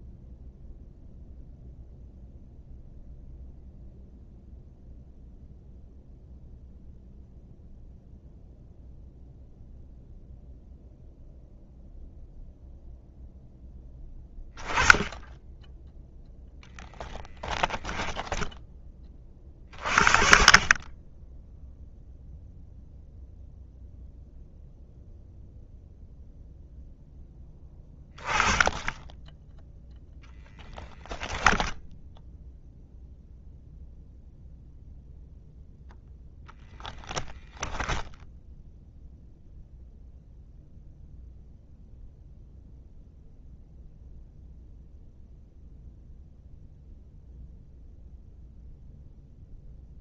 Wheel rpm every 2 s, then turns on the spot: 0, 0, 0, 0, 0, 0, 0, 20, 0, 10, 30, 0, 0, 0, 20, 0, 0, 0, 10, 0, 0, 0, 0, 0, 0.
none